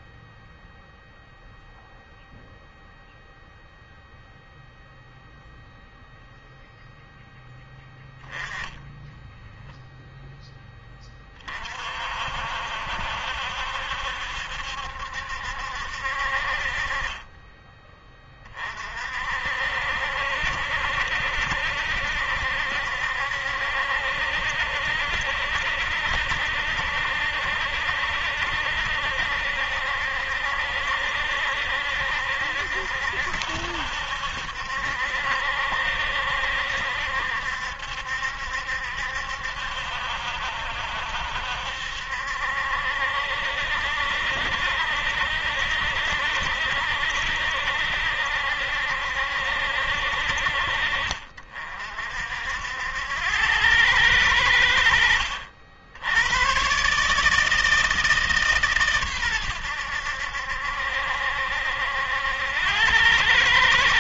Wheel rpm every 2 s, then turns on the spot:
0, 0, 0, 0, 10, 30, 70, 70, 30, 50, 60, 70, 70, 70, 70, 70, 70, 70, 70, 70, 70, 70, 70, 70, 70, 50, 80, 70, 140, 120, 70, 100.
none